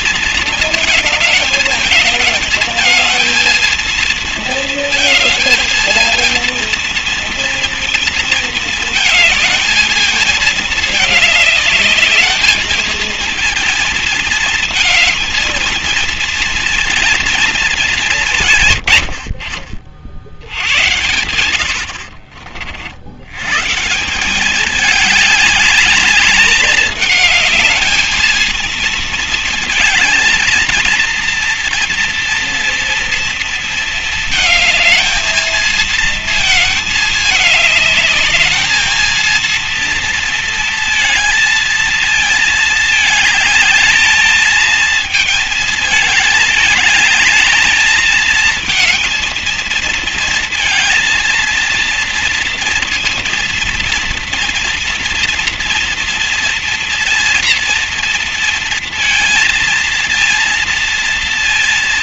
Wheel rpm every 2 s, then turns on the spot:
230, 220, 230, 230, 230, 220, 210, 220, 230, 180, 70, 60, 170, 210, 220, 220, 230, 220, 220, 210, 230, 230, 220, 220, 220, 230, 230, 230, 230, 230, 230.
22-24